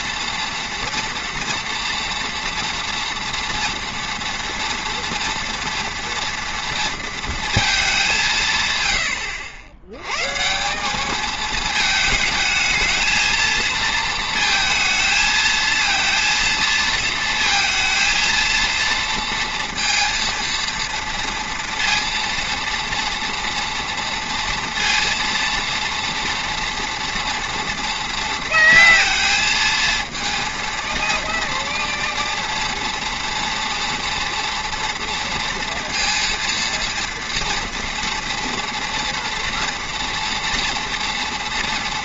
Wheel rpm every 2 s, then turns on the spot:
240, 230, 240, 230, 130, 170, 220, 220, 230, 230, 230, 230, 230, 230, 230, 230, 230, 230, 230, 240, 230.
none